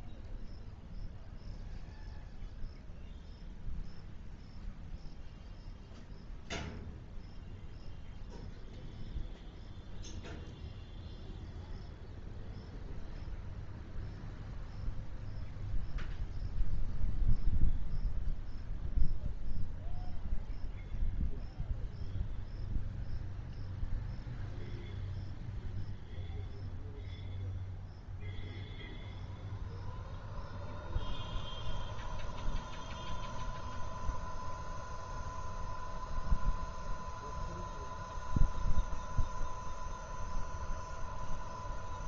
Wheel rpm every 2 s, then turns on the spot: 0, 0, 0, 0, 0, 0, 0, 0, 0, 0, 0, 0, 0, 0, 0, 0, 0, 0, 0, 0, 0.
none